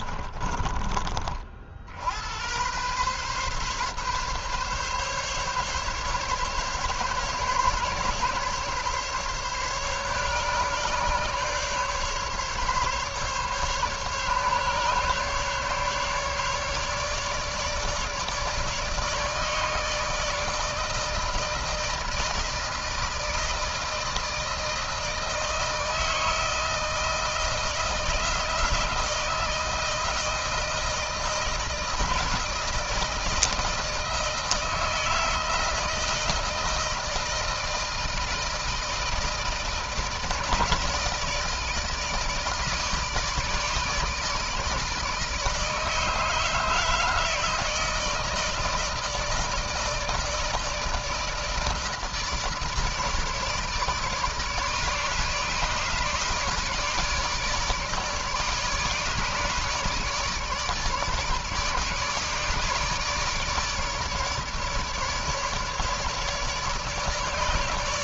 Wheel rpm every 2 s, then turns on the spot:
40, 120, 140, 140, 140, 140, 140, 140, 150, 150, 160, 160, 160, 160, 160, 160, 160, 160, 160, 160, 150, 150, 150, 150, 160, 160, 150, 150, 150, 150, 150, 150, 150, 150.
none